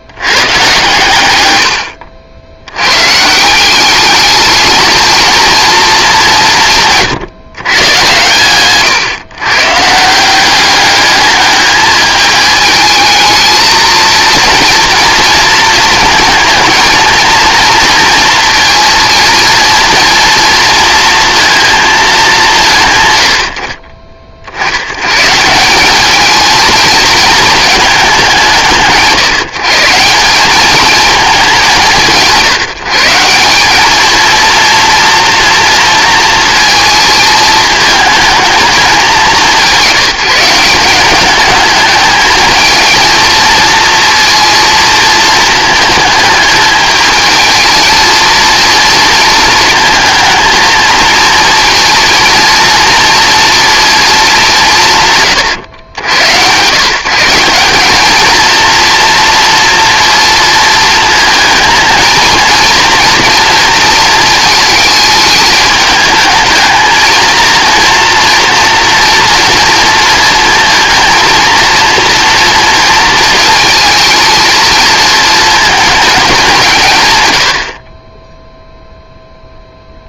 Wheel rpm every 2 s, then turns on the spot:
120, 100, 220, 170, 120, 200, 220, 230, 220, 230, 230, 150, 90, 220, 160, 210, 160, 230, 220, 210, 180, 220, 230, 210, 230, 230, 230, 170, 140, 230, 220, 230, 220, 220, 230, 230, 230, 220, 160, 0.
none